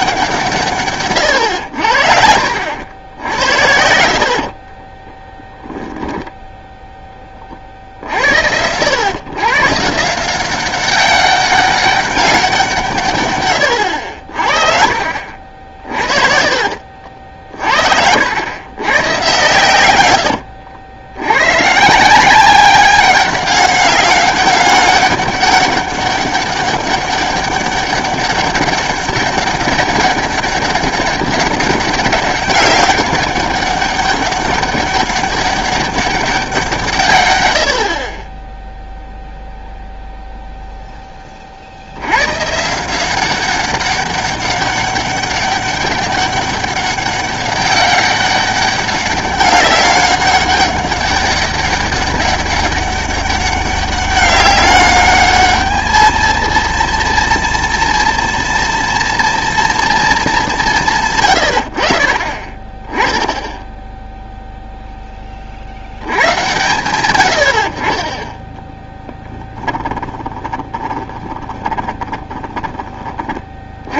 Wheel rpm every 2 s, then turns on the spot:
160, 70, 40, 0, 90, 190, 180, 50, 50, 110, 90, 190, 200, 200, 200, 200, 200, 200, 190, 10, 0, 140, 200, 200, 200, 200, 200, 200, 230, 230, 190, 20, 0, 120, 10, 20, 30.
4-6 16-18 70-74